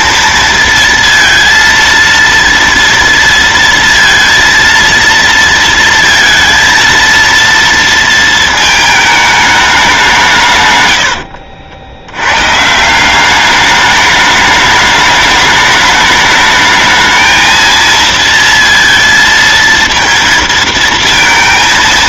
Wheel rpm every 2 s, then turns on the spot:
230, 230, 230, 230, 230, 170, 100, 210, 210, 230, 230.
none